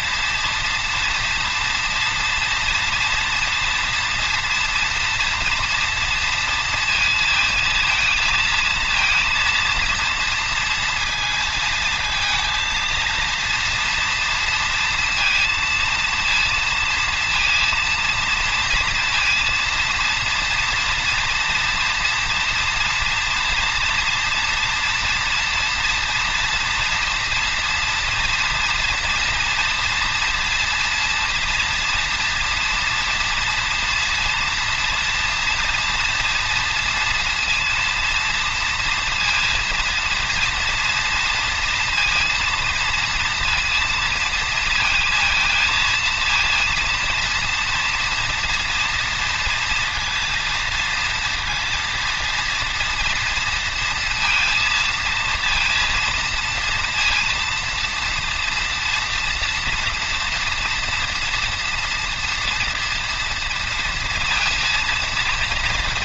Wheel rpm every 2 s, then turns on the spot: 230, 230, 240, 230, 230, 230, 230, 230, 230, 230, 230, 230, 240, 240, 230, 230, 230, 230, 240, 230, 230, 230, 220, 230, 230, 230, 230, 230, 230, 230, 230, 230, 230.
none